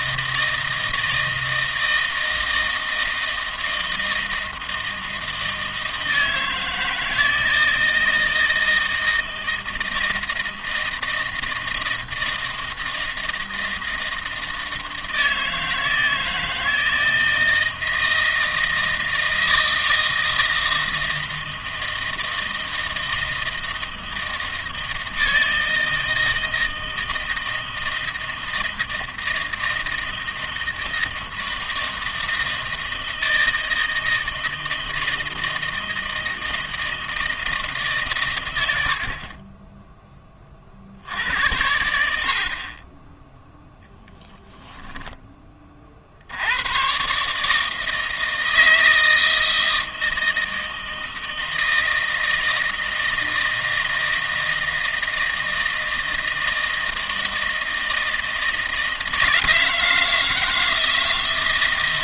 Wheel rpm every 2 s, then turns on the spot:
160, 160, 160, 160, 160, 160, 160, 160, 160, 160, 160, 160, 160, 160, 160, 160, 160, 160, 160, 90, 50, 50, 0, 100, 160, 160, 160, 160, 160, 160, 160.
none